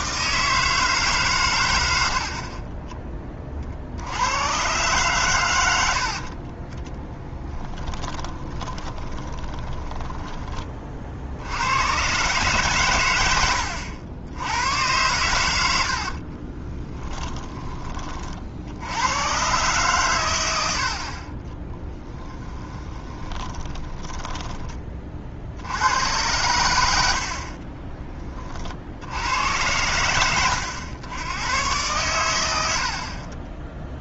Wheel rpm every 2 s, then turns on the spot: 160, 30, 120, 20, 20, 20, 130, 100, 20, 80, 80, 10, 20, 100, 50, 100, 80.
6-10 16-18 22-24